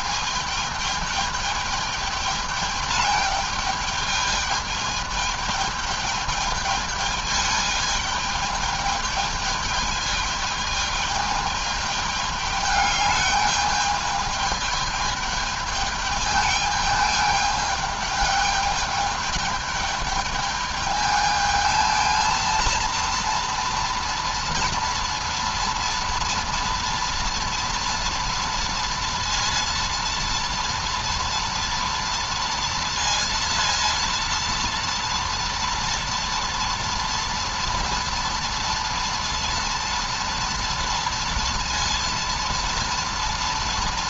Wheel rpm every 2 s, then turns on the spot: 220, 210, 220, 210, 210, 210, 210, 210, 210, 210, 210, 230, 230, 230, 230, 230, 230, 230, 240, 230, 230, 230.
none